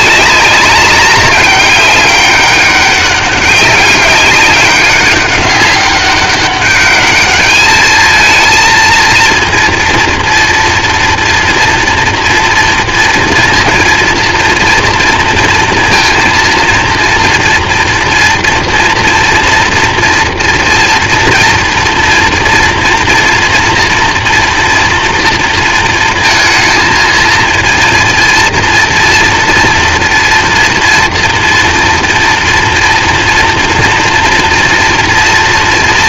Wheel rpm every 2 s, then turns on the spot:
200, 200, 200, 200, 230, 230, 230, 230, 230, 230, 230, 230, 230, 230, 230, 230, 230, 230.
none